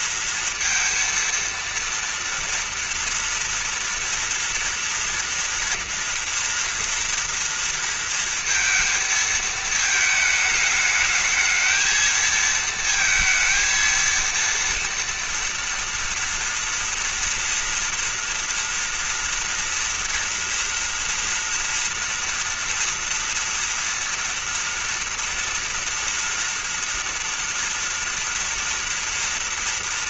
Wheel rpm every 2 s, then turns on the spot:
230, 230, 230, 230, 230, 220, 230, 230, 230, 230, 240, 230, 230, 230, 240.
none